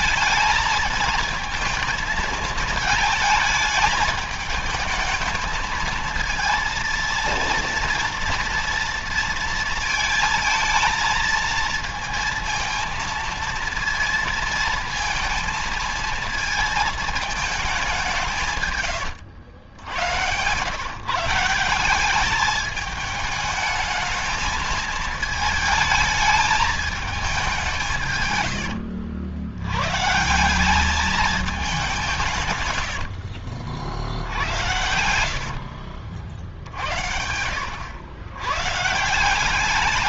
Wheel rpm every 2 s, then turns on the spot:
220, 220, 220, 230, 230, 220, 230, 230, 220, 150, 120, 210, 220, 220, 110, 190, 130, 80, 60, 120.
18-20 28-30 34-36